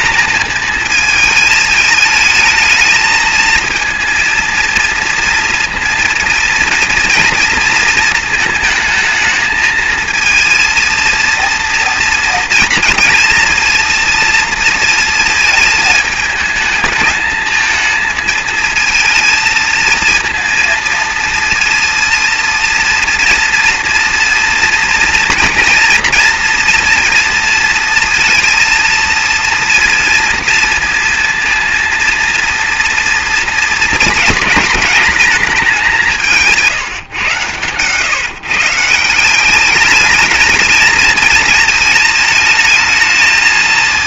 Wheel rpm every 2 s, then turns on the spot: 230, 220, 230, 230, 220, 230, 230, 230, 210, 220, 230, 230, 230, 240, 230, 230, 230, 220, 160, 150, 220, 220.
none